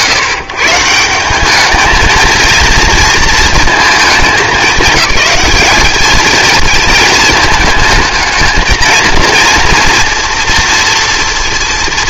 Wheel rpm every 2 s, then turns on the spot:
140, 230, 210, 230, 230, 240.
none